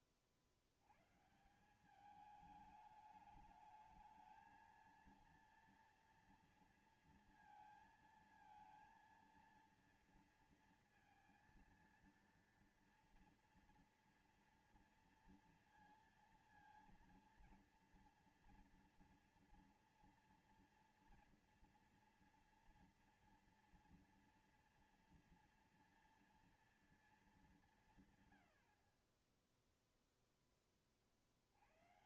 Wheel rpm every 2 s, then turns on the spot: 50, 210, 220, 230, 220, 230, 230, 230, 230, 230, 240, 240, 230, 230, 90, 10.
none